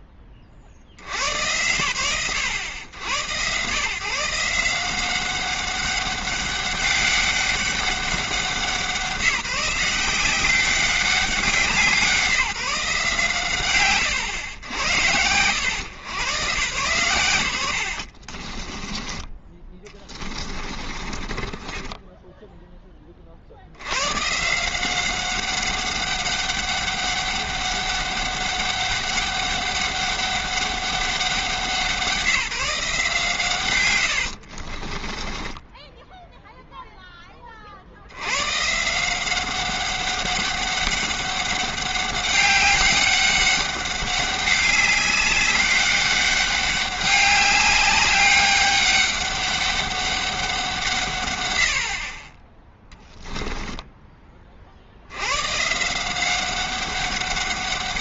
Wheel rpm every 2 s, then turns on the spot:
10, 110, 170, 200, 190, 190, 160, 100, 140, 30, 30, 10, 160, 200, 200, 200, 160, 50, 0, 120, 200, 200, 200, 200, 200, 180, 10, 50, 190.
18-22 34-36